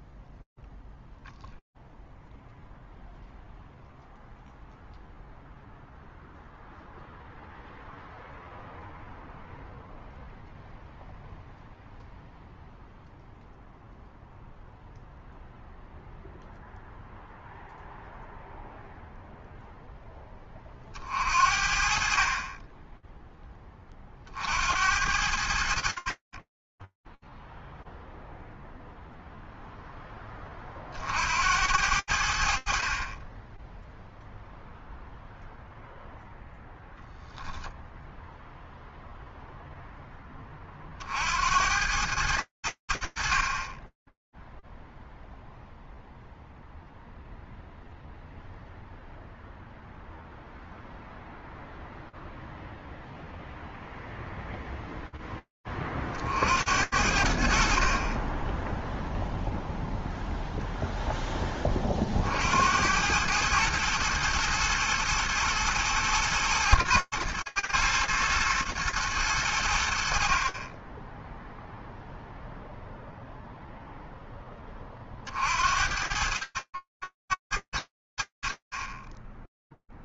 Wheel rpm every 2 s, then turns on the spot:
0, 0, 0, 0, 0, 0, 0, 0, 0, 10, 40, 50, 40, 0, 10, 80, 0, 0, 0, 10, 100, 10, 0, 0, 0, 0, 0, 50, 30, 0, 40, 110, 110, 120, 60, 0, 10, 80, 110, 0.
none